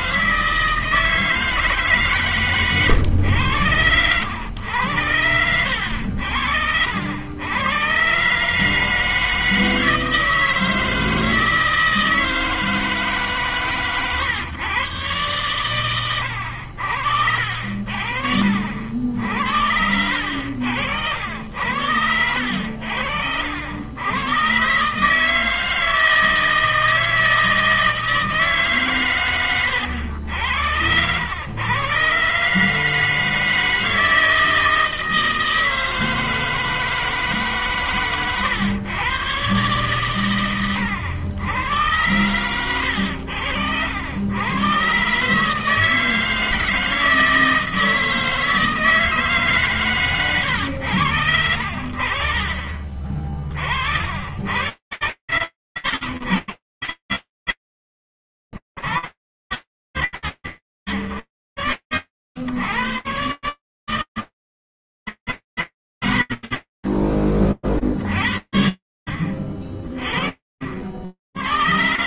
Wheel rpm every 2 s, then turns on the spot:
160, 150, 100, 80, 120, 160, 160, 140, 110, 60, 80, 80, 90, 160, 160, 90, 130, 160, 160, 130, 130, 100, 90, 160, 160, 130, 50, 80, 90, 80, 80, 120, 130, 40, 50, 90.
none